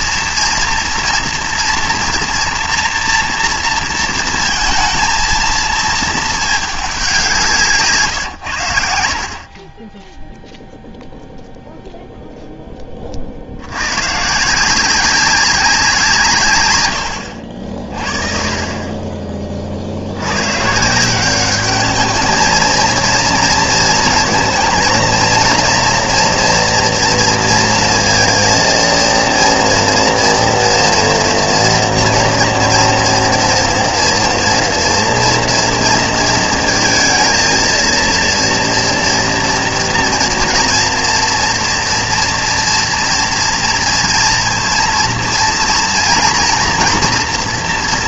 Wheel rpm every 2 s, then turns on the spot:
230, 240, 230, 210, 100, 0, 10, 160, 130, 30, 120, 230, 230, 230, 230, 240, 230, 230, 230, 230, 230, 240, 230, 230.
none